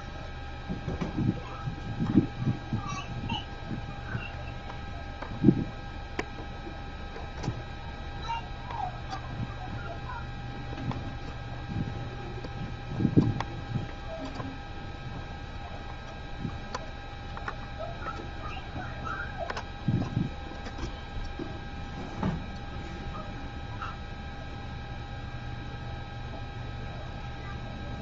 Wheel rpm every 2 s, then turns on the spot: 0, 0, 0, 0, 0, 0, 0, 0, 0, 0, 0, 0, 0, 0.
none